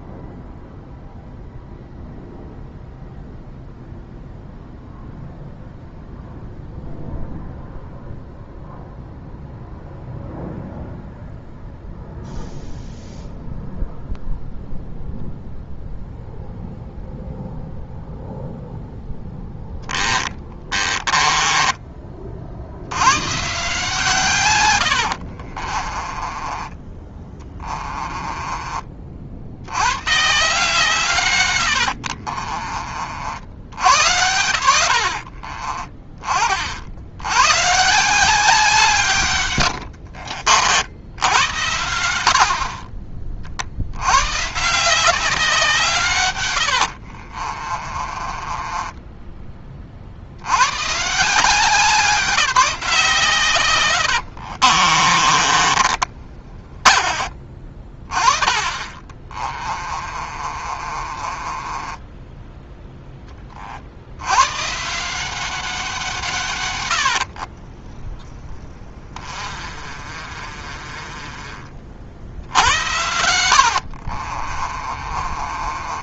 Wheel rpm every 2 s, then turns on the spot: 0, 0, 0, 0, 0, 0, 0, 0, 0, 0, 20, 80, 100, 20, 40, 150, 30, 80, 70, 160, 70, 40, 170, 80, 20, 120, 160, 50, 30, 20, 40, 10, 170, 100, 30, 30, 80, 30.
20-22 24-28 46-50 54-62 66-76